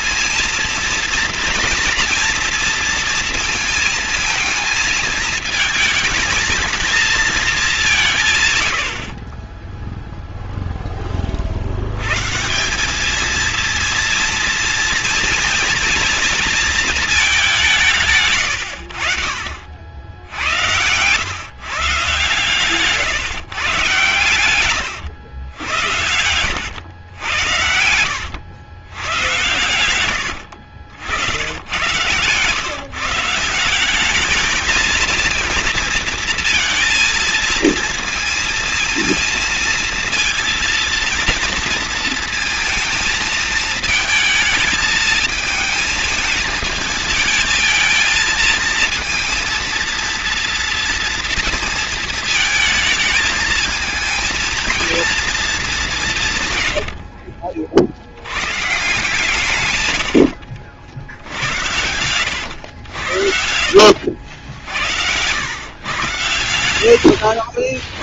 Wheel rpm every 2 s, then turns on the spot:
230, 230, 220, 220, 90, 10, 200, 230, 230, 80, 110, 140, 110, 110, 110, 70, 140, 220, 230, 230, 230, 230, 220, 220, 230, 230, 220, 230, 70, 150, 80, 90, 80, 70.
24-26 56-58 60-62 66-68